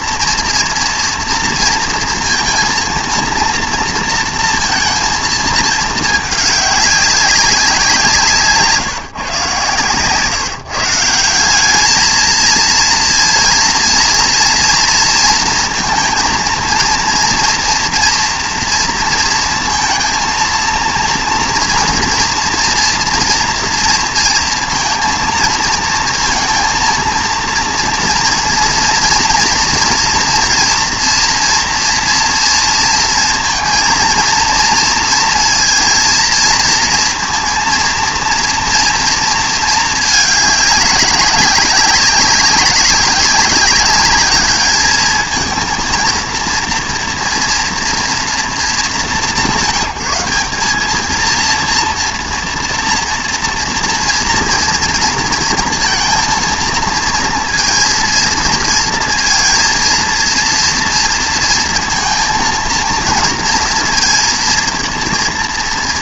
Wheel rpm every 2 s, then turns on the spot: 240, 230, 230, 200, 160, 160, 230, 230, 230, 230, 230, 230, 230, 230, 230, 230, 230, 230, 230, 230, 200, 190, 210, 230, 200, 210, 230, 230, 230, 230, 230, 230, 230.
none